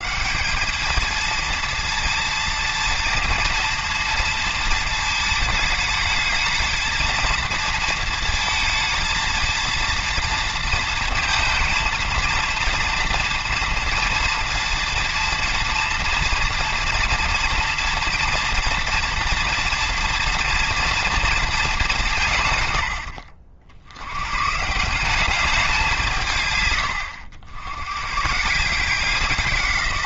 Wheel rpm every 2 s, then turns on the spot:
220, 230, 220, 230, 230, 230, 230, 230, 230, 240, 230, 90, 170, 100, 180.
none